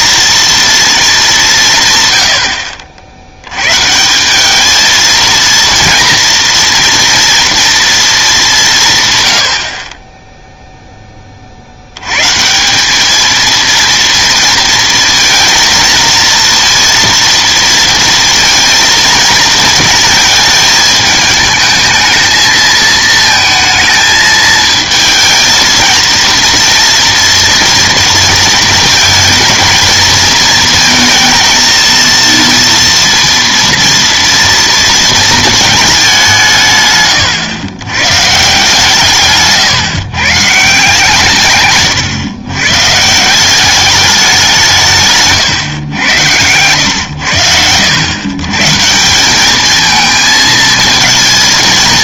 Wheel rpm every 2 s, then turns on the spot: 230, 60, 210, 230, 180, 0, 160, 230, 230, 230, 220, 220, 220, 230, 230, 230, 230, 230, 160, 150, 140, 130, 190, 100, 140, 220.
none